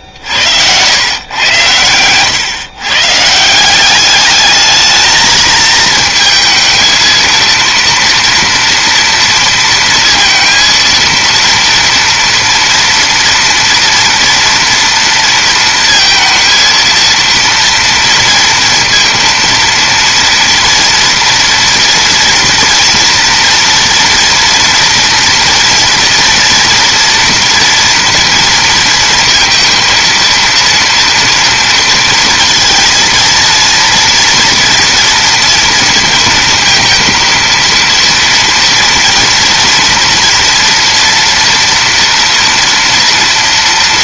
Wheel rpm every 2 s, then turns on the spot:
100, 130, 220, 230, 230, 230, 230, 230, 230, 230, 230, 230, 230, 230, 230, 230, 230, 230, 230, 230, 230, 240.
none